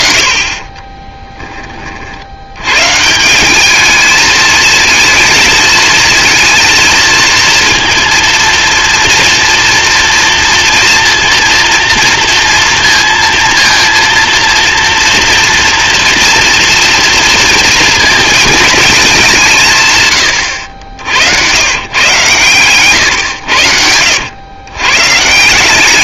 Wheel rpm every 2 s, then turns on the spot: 30, 110, 220, 230, 230, 230, 230, 230, 230, 220, 90, 120, 120.
0-2